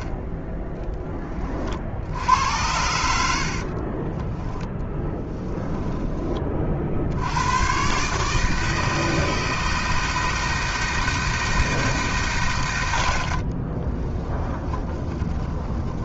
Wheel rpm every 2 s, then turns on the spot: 10, 80, 10, 70, 160, 160, 80, 20.
4-6 12-16